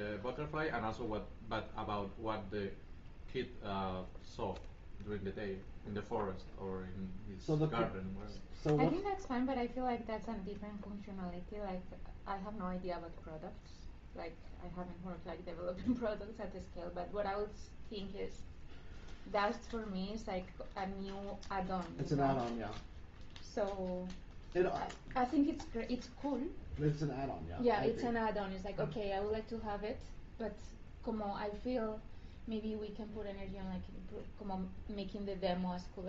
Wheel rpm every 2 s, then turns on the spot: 0, 0, 0, 0, 0, 0, 0, 0, 0, 0, 0, 0, 0, 0, 0, 0, 0, 0.
none